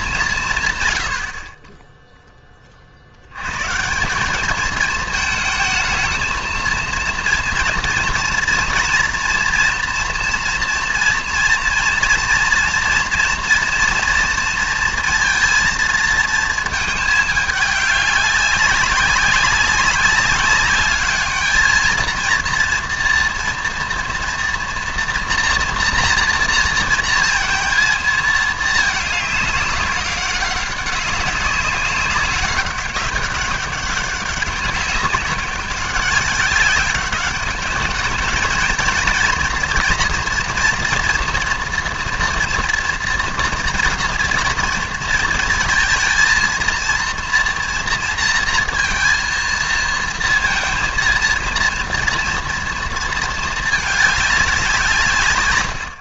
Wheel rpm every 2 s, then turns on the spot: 150, 20, 210, 230, 230, 230, 230, 230, 220, 200, 210, 230, 230, 230, 220, 200, 190, 200, 200, 230, 230, 230, 230, 230, 230, 220, 230, 190.
none